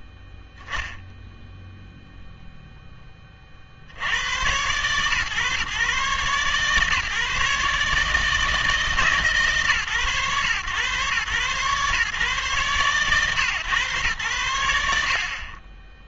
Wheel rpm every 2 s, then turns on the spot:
0, 0, 130, 130, 160, 120, 130, 60.
none